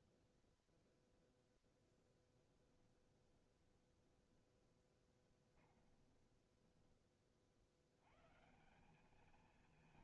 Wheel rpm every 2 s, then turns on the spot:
0, 20, 20, 10, 180.
2-6